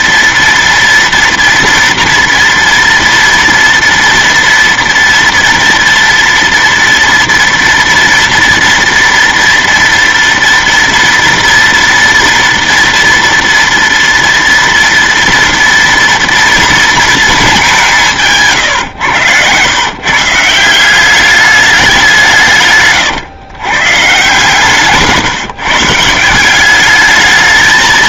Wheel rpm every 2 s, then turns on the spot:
230, 230, 240, 230, 230, 230, 230, 230, 230, 130, 170, 140, 160, 190.
18-20 22-26